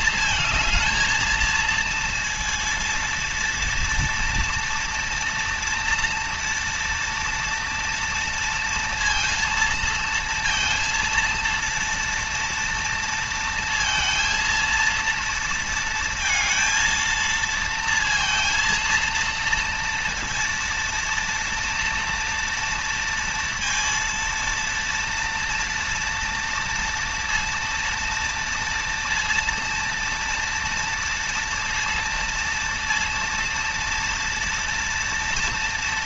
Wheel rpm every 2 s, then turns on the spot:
220, 230, 230, 230, 230, 230, 230, 230, 230, 230, 230, 230, 230, 230, 230, 230, 230, 230.
none